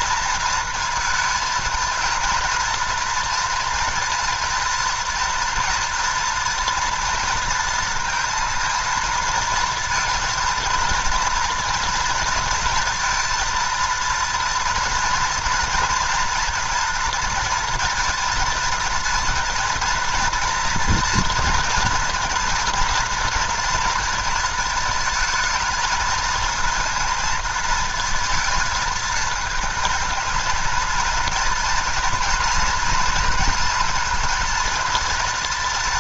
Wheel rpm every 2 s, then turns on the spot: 230, 240, 230, 230, 230, 230, 230, 230, 230, 230, 230, 240, 220, 230, 230, 220, 230, 230.
none